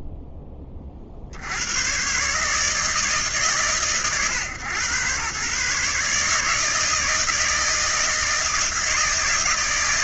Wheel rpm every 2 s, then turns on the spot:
20, 150, 120, 150, 160.
none